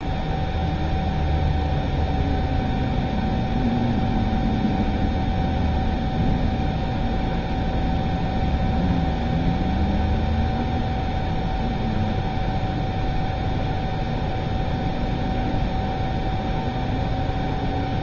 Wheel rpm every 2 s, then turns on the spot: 0, 0, 0, 0, 0, 0, 0, 0, 0.
none